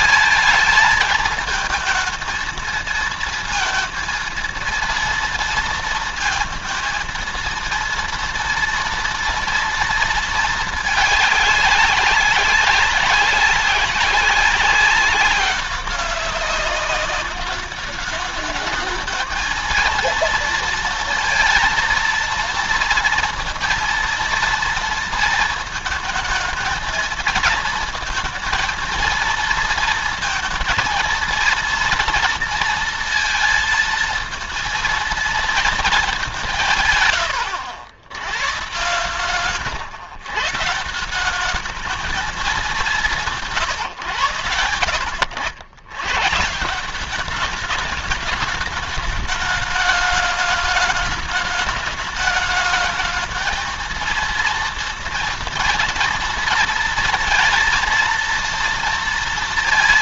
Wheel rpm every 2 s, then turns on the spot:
220, 220, 230, 230, 240, 220, 190, 200, 200, 210, 230, 230, 230, 220, 230, 230, 230, 230, 180, 120, 150, 200, 100, 160, 210, 210, 210, 230, 230, 230.
none